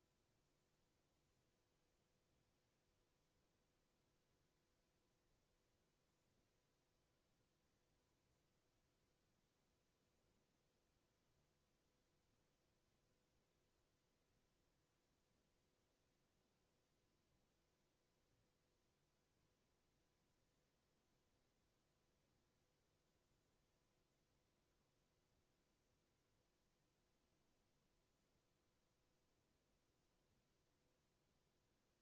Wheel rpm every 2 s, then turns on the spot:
0, 0, 0, 0, 0, 0, 0, 0, 0, 0, 0, 0, 0, 0, 0, 0.
none